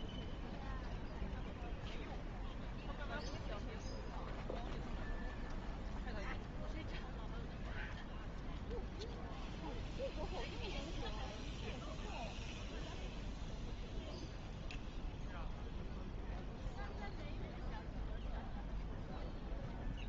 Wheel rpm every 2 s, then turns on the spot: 0, 0, 0, 0, 0, 0, 0, 0, 0, 0.
none